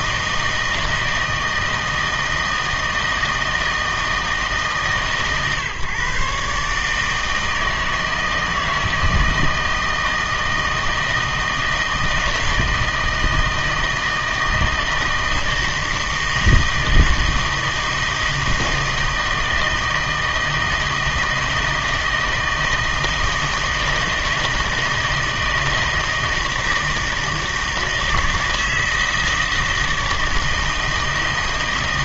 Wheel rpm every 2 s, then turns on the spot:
160, 160, 150, 150, 160, 160, 160, 160, 160, 160, 160, 160, 160, 160, 160, 160.
none